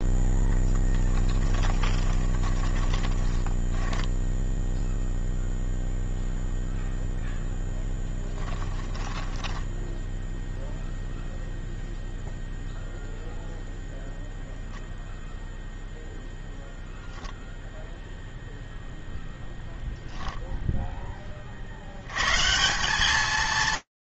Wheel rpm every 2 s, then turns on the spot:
10, 20, 0, 0, 10, 0, 0, 0, 0, 0, 10, 180.
0-4 8-10